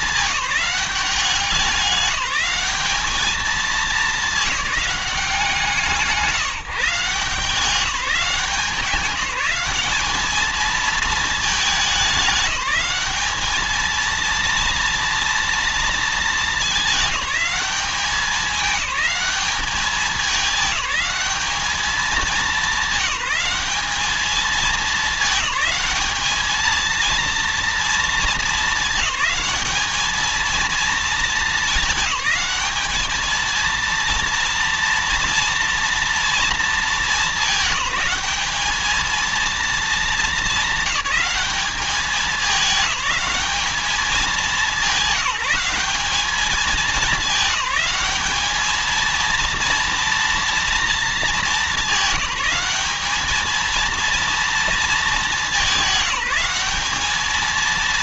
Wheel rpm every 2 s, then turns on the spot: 190, 210, 190, 170, 180, 220, 210, 230, 210, 200, 210, 210, 210, 230, 210, 220, 220, 230, 200, 220, 220, 210, 210, 210, 230, 220, 220, 210, 210.
none